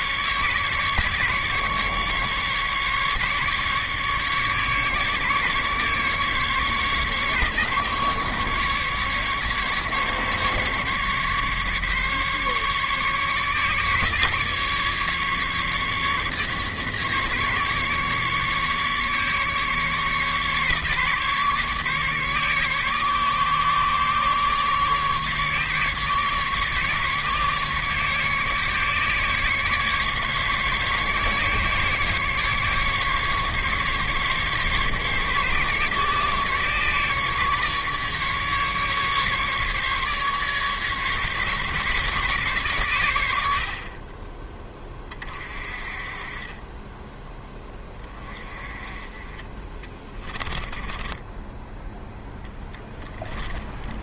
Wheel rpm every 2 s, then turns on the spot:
150, 150, 150, 150, 150, 150, 140, 150, 150, 150, 150, 150, 150, 150, 150, 140, 150, 140, 150, 150, 150, 120, 20, 20, 20, 10, 10.
50-54